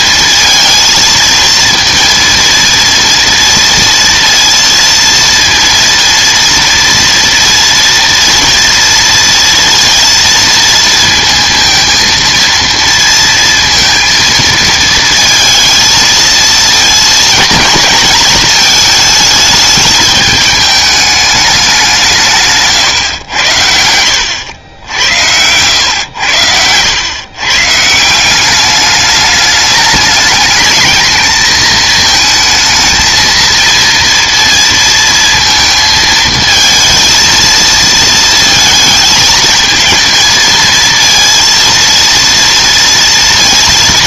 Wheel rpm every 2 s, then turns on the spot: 230, 230, 230, 230, 230, 230, 230, 220, 220, 220, 210, 150, 90, 100, 200, 220, 220, 230, 220, 230, 220, 230.
none